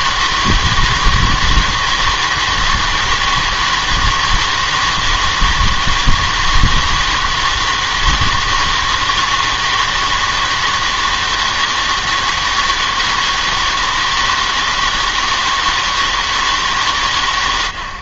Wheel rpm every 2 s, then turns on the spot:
160, 160, 160, 160, 160, 160, 160, 160, 150.
none